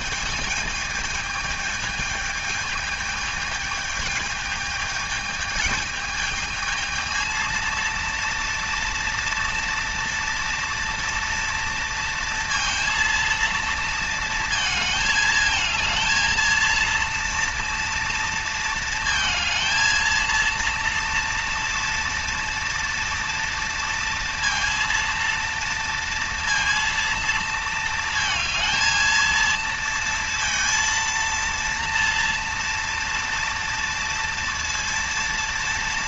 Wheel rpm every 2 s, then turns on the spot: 220, 220, 220, 220, 230, 230, 230, 220, 230, 230, 230, 230, 230, 230, 230, 230, 230, 230.
none